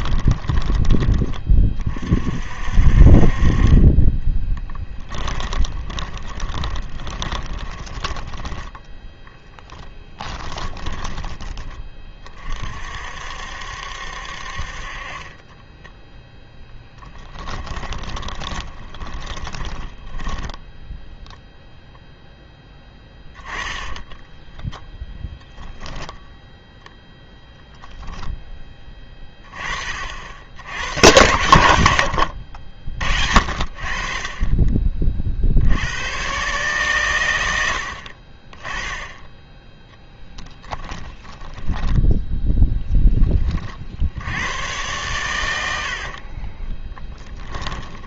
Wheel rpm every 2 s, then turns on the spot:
20, 50, 10, 20, 10, 20, 50, 50, 10, 20, 0, 10, 10, 0, 20, 80, 70, 30, 130, 20, 20, 0, 110, 20.
4-8 10-12 16-20 24-26 40-42 46-48